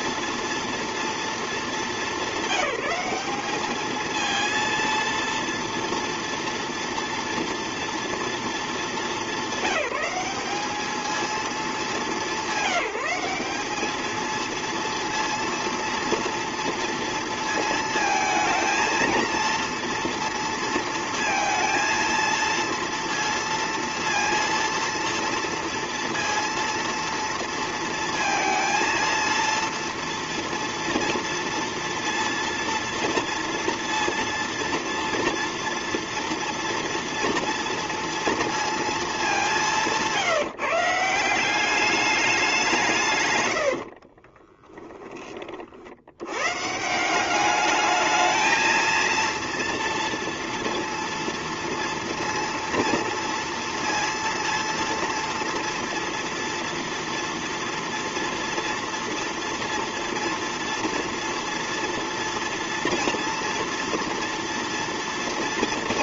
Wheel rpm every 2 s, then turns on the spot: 230, 190, 230, 230, 210, 220, 200, 230, 230, 220, 230, 230, 230, 230, 230, 240, 230, 230, 230, 230, 170, 170, 20, 150, 230, 230, 230, 230, 230, 230, 230, 230, 230.
none